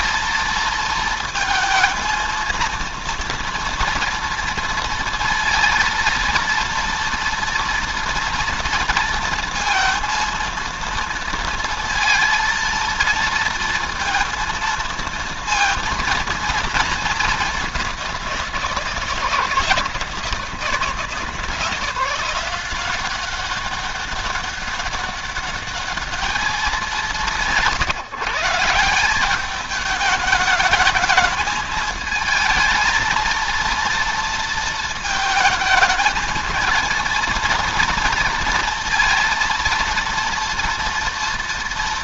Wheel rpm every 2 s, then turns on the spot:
230, 230, 230, 230, 230, 230, 230, 230, 220, 170, 160, 180, 200, 200, 170, 210, 230, 230, 220, 230, 230.
none